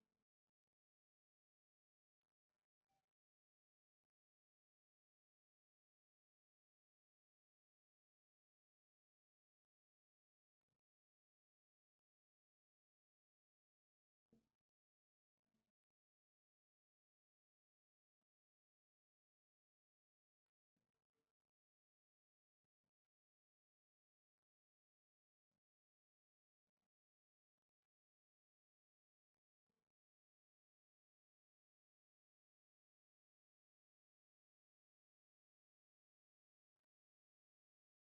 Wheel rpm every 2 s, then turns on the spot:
0, 0, 0, 0, 0, 0, 0, 0, 0, 0, 0, 0, 0, 0, 0, 0, 0, 0, 0.
none